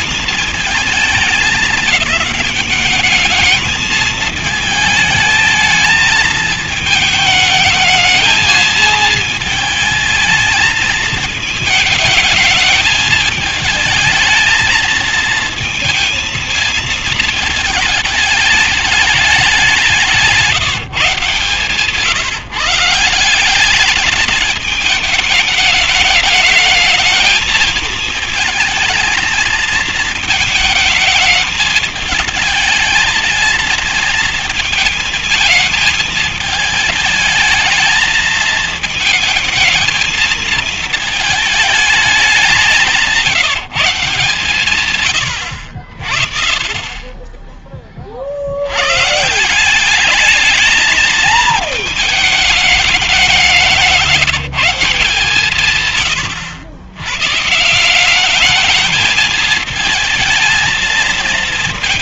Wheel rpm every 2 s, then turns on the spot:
220, 210, 220, 220, 220, 220, 220, 220, 230, 210, 170, 170, 220, 220, 230, 230, 220, 220, 210, 220, 220, 190, 130, 40, 80, 210, 210, 170, 120, 210, 220.
none